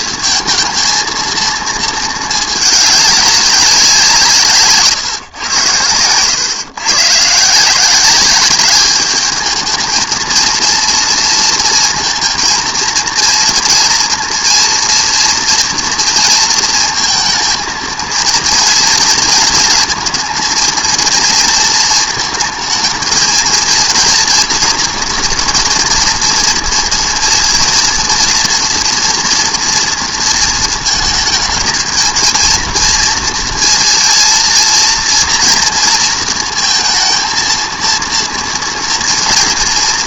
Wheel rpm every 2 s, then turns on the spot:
220, 190, 120, 170, 220, 230, 230, 230, 230, 230, 230, 230, 230, 230, 240, 220, 230, 230, 230, 230.
none